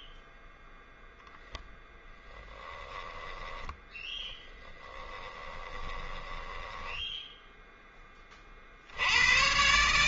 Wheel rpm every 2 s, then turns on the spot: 0, 10, 10, 10, 50.
2-8